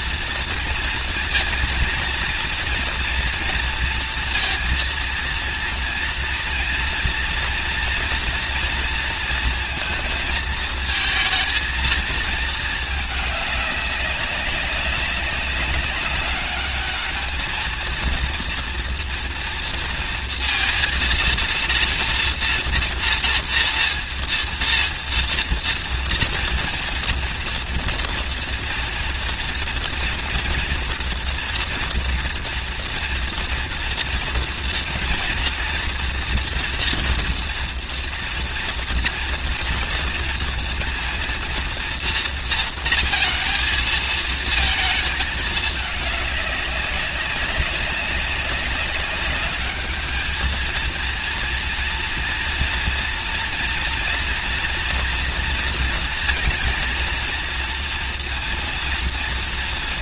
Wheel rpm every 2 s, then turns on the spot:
230, 230, 230, 230, 230, 220, 220, 200, 210, 230, 230, 240, 230, 230, 240, 230, 230, 230, 240, 230, 230, 230, 220, 200, 190, 220, 230, 230, 230, 230.
none